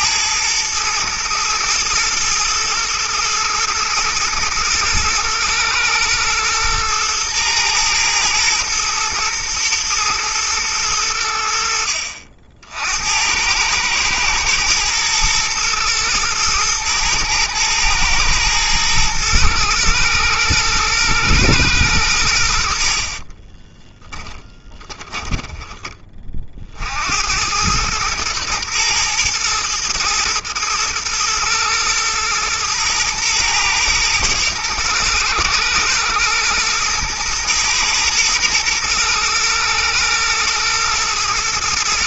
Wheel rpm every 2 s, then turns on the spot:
110, 110, 110, 120, 110, 110, 70, 110, 110, 110, 120, 60, 20, 60, 110, 110, 120, 110, 120, 120, 110.
22-26